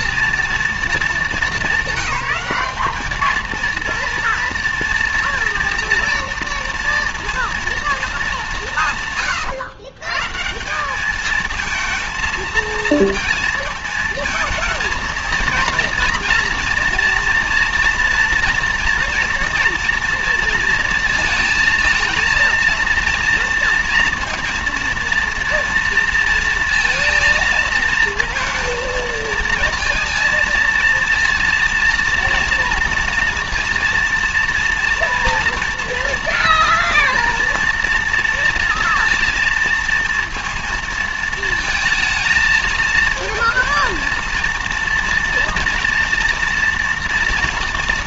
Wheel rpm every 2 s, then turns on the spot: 230, 210, 240, 230, 160, 190, 220, 220, 240, 240, 230, 230, 230, 230, 230, 230, 230, 230, 240, 230, 230, 230, 230, 230.
none